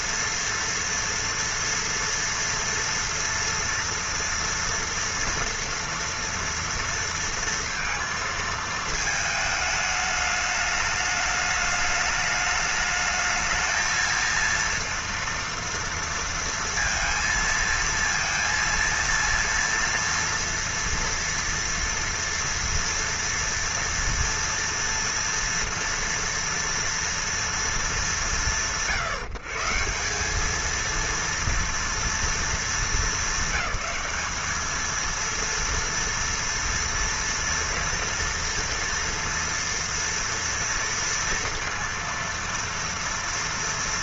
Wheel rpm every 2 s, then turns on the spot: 230, 230, 230, 230, 220, 210, 210, 230, 230, 230, 230, 230, 240, 230, 140, 220, 220, 220, 230, 230, 230, 230.
none